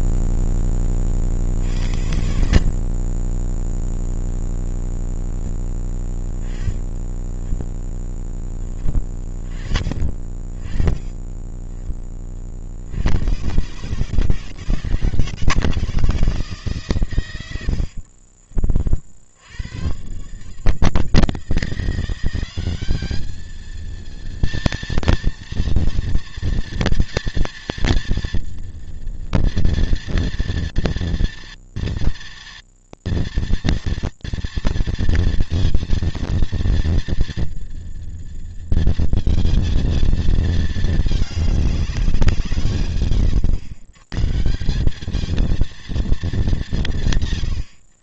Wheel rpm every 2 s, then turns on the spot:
0, 50, 0, 20, 20, 30, 50, 140, 150, 40, 150, 200, 230, 240, 240, 230, 230, 230, 230, 230, 220, 160, 170, 170.
6-8